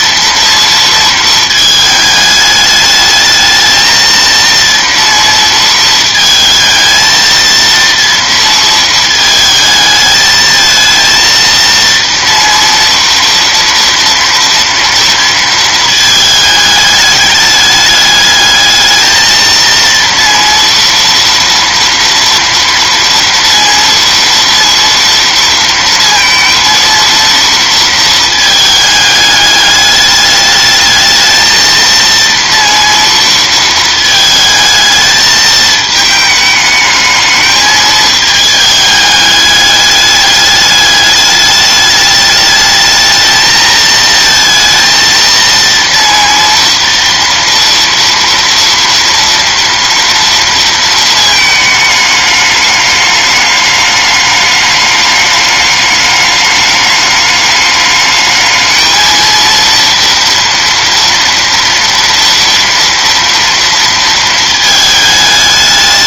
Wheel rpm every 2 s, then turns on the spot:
230, 210, 230, 220, 230, 220, 230, 230, 210, 210, 230, 230, 230, 230, 220, 210, 230, 220, 210, 220, 210, 210, 230, 230, 230, 230, 210, 210, 210, 220, 230, 230, 220.
none